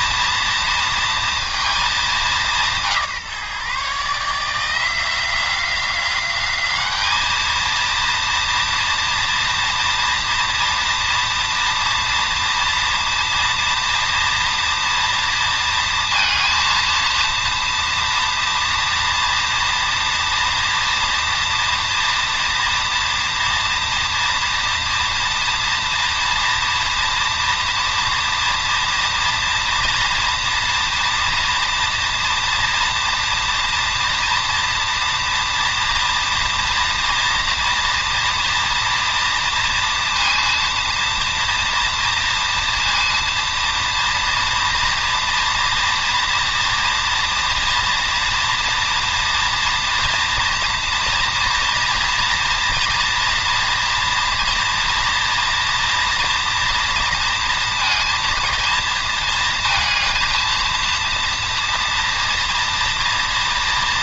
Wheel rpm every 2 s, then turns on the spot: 230, 170, 170, 210, 230, 230, 230, 230, 230, 240, 230, 230, 230, 230, 240, 240, 230, 230, 230, 230, 230, 230, 230, 240, 230, 230, 230, 230, 230, 230, 230, 240.
none